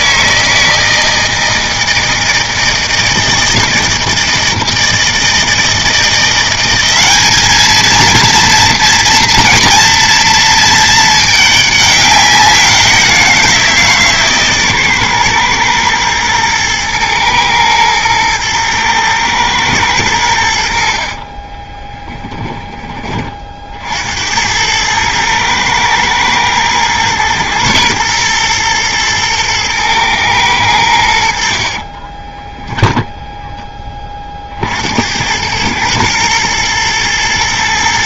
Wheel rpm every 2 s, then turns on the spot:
160, 160, 160, 190, 230, 230, 190, 140, 120, 110, 70, 20, 90, 110, 120, 100, 10, 50, 110.
22-24 32-34